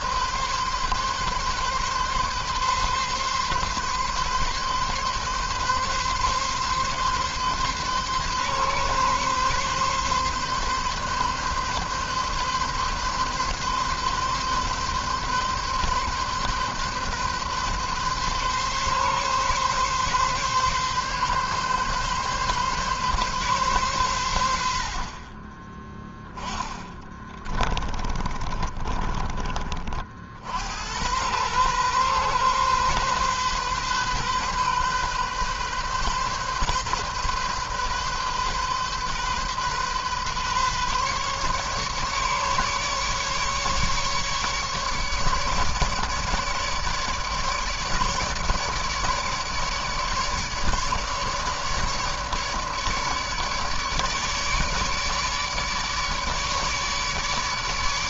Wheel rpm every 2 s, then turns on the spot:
140, 130, 140, 140, 140, 140, 130, 140, 140, 140, 140, 130, 30, 20, 40, 110, 130, 130, 130, 130, 140, 140, 150, 150, 150, 150, 150, 150, 150.
26-28